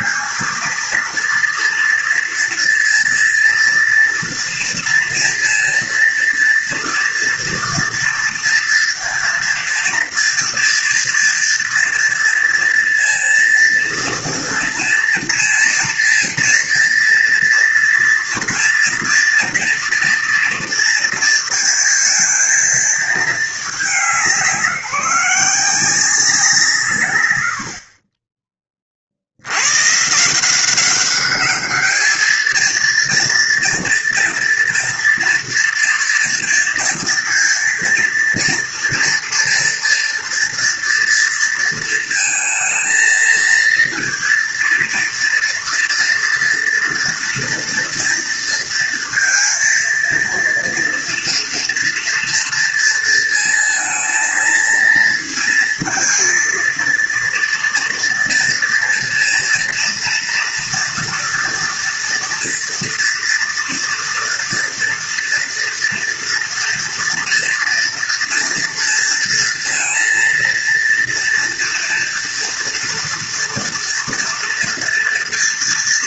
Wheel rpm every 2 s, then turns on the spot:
230, 230, 230, 230, 230, 230, 230, 230, 230, 230, 230, 230, 190, 160, 30, 190, 220, 230, 230, 230, 230, 230, 230, 230, 230, 230, 230, 230, 230, 230, 240, 230, 230, 230, 230, 230, 240, 230.
none